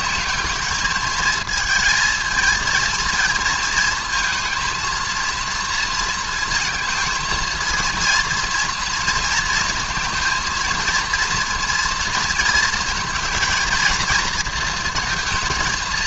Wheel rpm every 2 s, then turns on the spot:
210, 230, 230, 220, 230, 230, 220, 230.
none